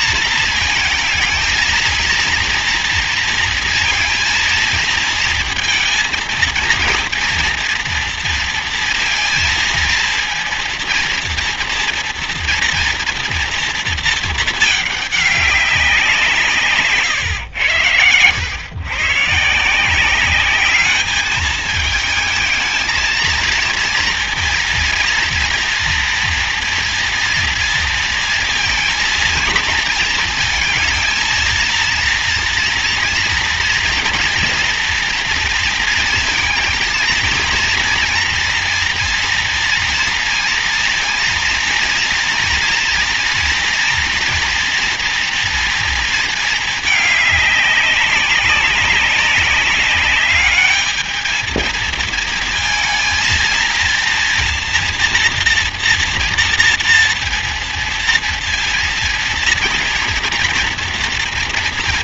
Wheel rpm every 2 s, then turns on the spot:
220, 230, 230, 230, 230, 230, 230, 210, 160, 120, 200, 230, 230, 230, 230, 230, 230, 230, 230, 230, 230, 230, 230, 220, 200, 210, 220, 230, 230, 230, 230.
none